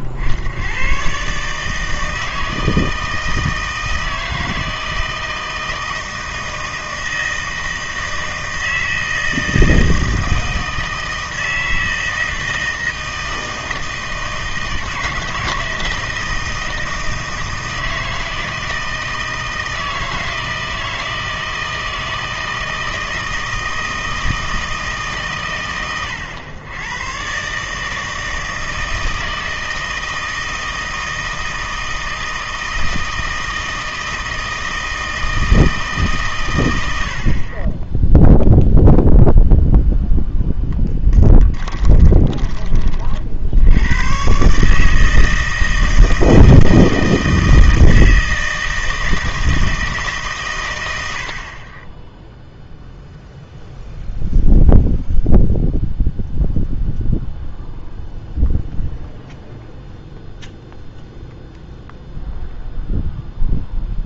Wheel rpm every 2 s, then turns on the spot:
100, 160, 160, 160, 160, 160, 160, 160, 160, 160, 160, 160, 160, 100, 160, 160, 160, 160, 100, 0, 10, 30, 150, 160, 160, 120, 0, 0, 0, 0, 0, 0.
40-42